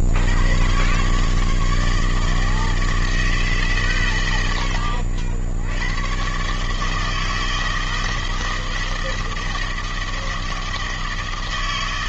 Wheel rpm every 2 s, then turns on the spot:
80, 160, 130, 140, 160, 160.
none